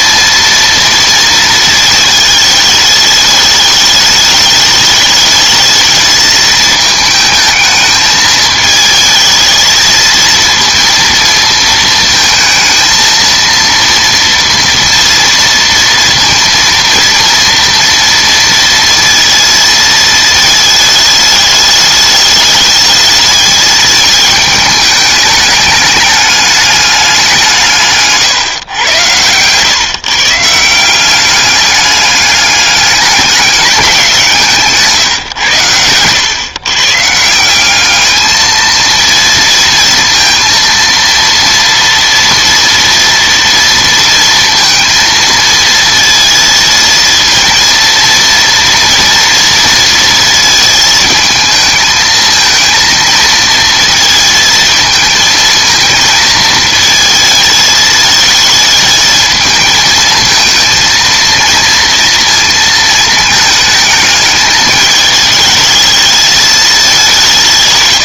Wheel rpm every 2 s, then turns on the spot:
230, 210, 210, 220, 220, 230, 220, 230, 230, 230, 220, 210, 210, 200, 120, 160, 200, 160, 130, 220, 230, 230, 230, 230, 230, 220, 220, 220, 220, 220, 220, 230, 220, 210.
none